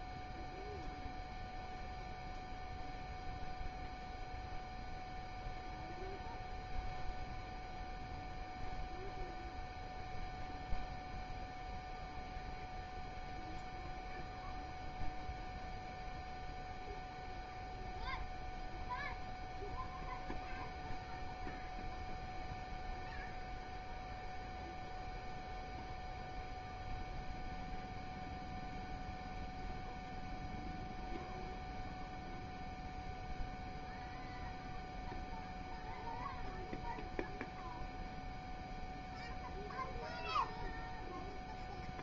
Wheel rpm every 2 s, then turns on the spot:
0, 0, 0, 0, 0, 0, 0, 0, 0, 0, 0, 0, 0, 0, 0, 0, 0, 0, 0, 0, 0.
none